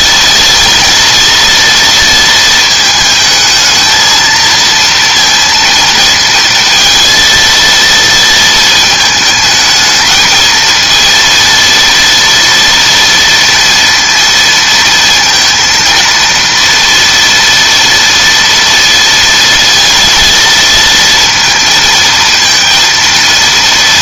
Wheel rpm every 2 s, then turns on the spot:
230, 220, 230, 230, 220, 230, 230, 230, 230, 230, 230, 230.
none